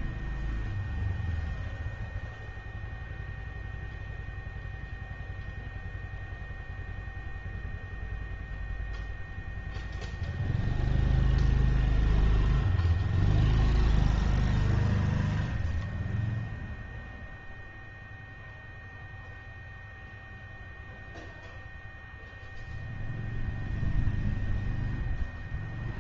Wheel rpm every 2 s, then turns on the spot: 0, 0, 0, 0, 0, 0, 0, 0, 0, 0, 0, 0, 0.
none